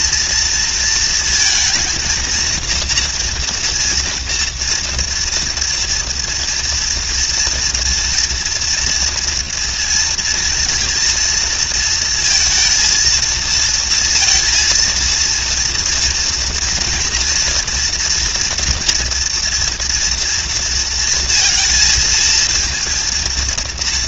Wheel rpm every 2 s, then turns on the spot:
230, 230, 230, 230, 230, 230, 230, 230, 230, 240, 230, 230.
none